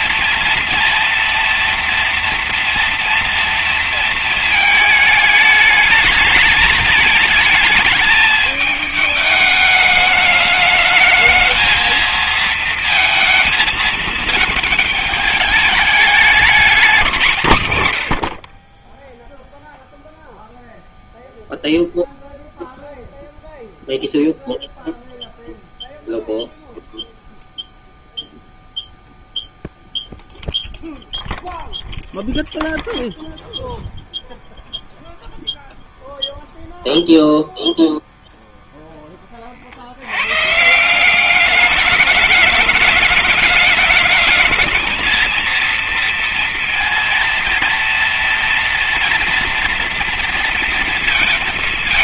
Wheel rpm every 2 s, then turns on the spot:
230, 230, 220, 220, 210, 220, 230, 220, 200, 30, 0, 0, 0, 0, 0, 0, 0, 0, 0, 20, 170, 210, 220, 230, 230, 230.
none